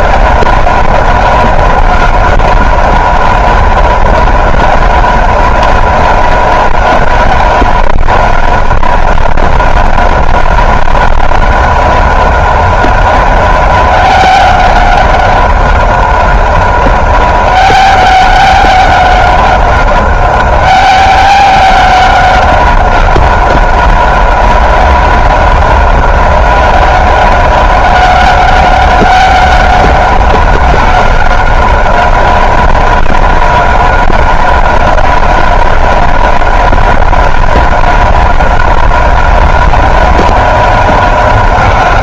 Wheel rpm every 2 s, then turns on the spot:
190, 190, 190, 190, 190, 190, 190, 190, 190, 190, 190, 190, 190, 190, 190, 190, 190, 190, 190, 190, 190.
none